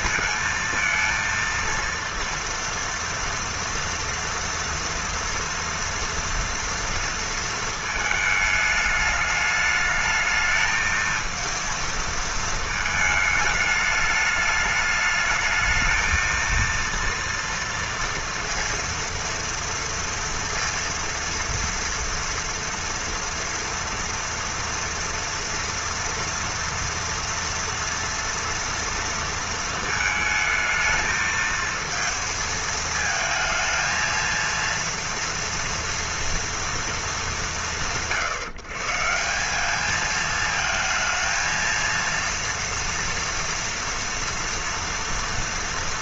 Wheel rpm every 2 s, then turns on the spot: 230, 230, 230, 230, 210, 220, 220, 210, 230, 230, 230, 230, 230, 230, 230, 220, 230, 230, 230, 150, 220, 230, 230.
none